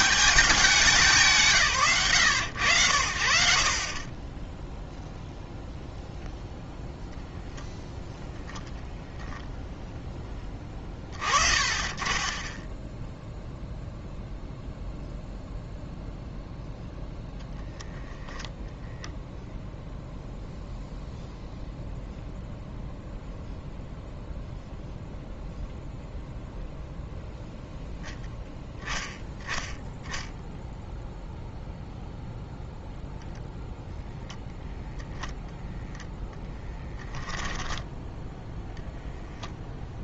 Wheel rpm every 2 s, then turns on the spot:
200, 90, 0, 0, 0, 30, 0, 0, 0, 0, 0, 0, 0, 0, 10, 0, 0, 0, 10, 0.
36-38